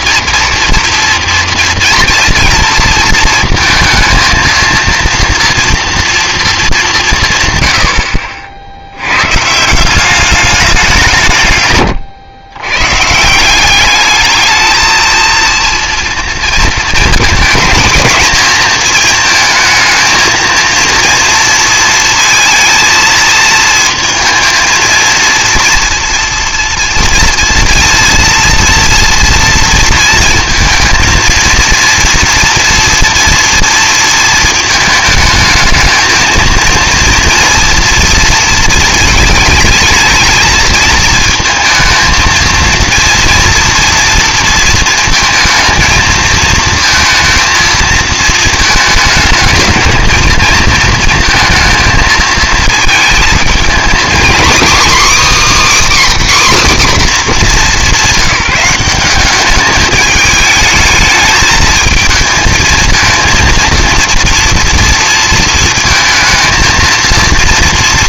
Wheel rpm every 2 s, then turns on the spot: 230, 230, 230, 220, 90, 180, 140, 220, 230, 220, 230, 220, 230, 230, 230, 230, 230, 220, 230, 220, 220, 230, 230, 230, 220, 220, 220, 280, 250, 190, 220, 220, 230, 230.
none